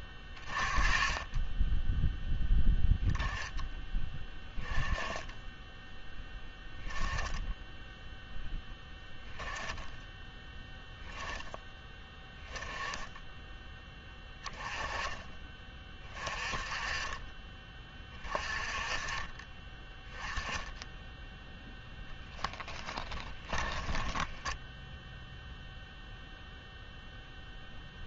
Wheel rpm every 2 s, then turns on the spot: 30, 0, 10, 10, 0, 10, 10, 10, 30, 30, 10, 20, 0, 0.
none